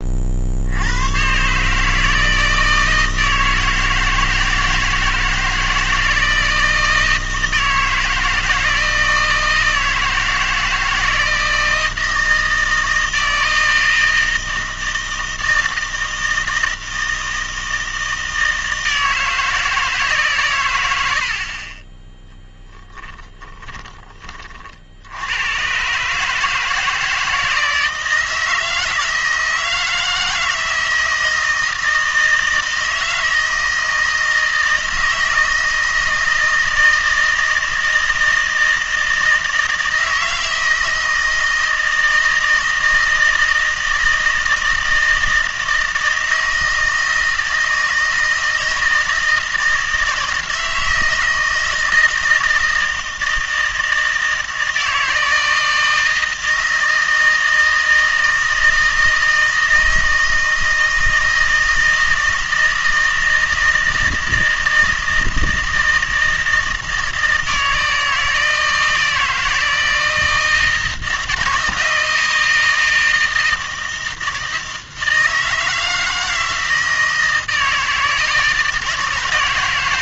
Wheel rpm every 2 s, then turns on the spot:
70, 160, 160, 160, 160, 160, 160, 160, 160, 160, 110, 20, 50, 160, 160, 160, 160, 160, 160, 160, 160, 160, 160, 160, 160, 160, 160, 160, 160, 160, 160, 160, 160, 160, 160, 160, 170, 160, 160, 160.
22-24